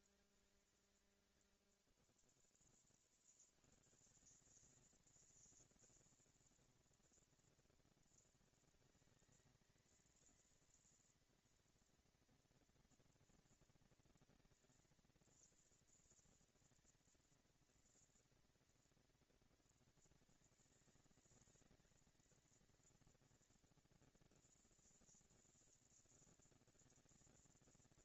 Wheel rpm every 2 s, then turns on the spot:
190, 30, 190, 220, 220, 230, 230, 230, 230, 230, 220, 230, 230, 230.
none